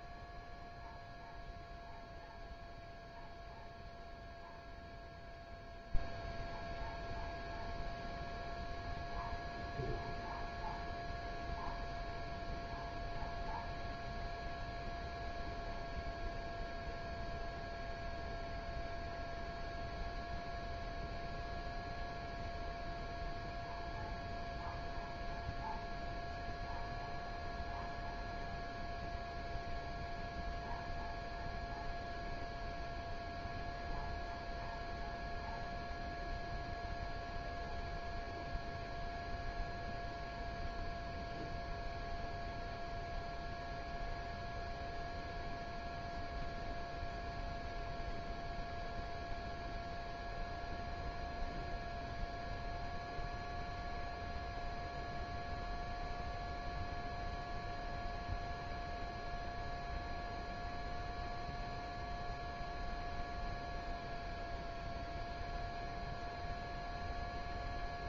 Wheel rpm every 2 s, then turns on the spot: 0, 0, 0, 0, 0, 0, 0, 0, 0, 0, 0, 0, 0, 0, 0, 0, 0, 0, 0, 0, 0, 0, 0, 0, 0, 0, 0, 0, 0, 0, 0, 0, 0, 0.
none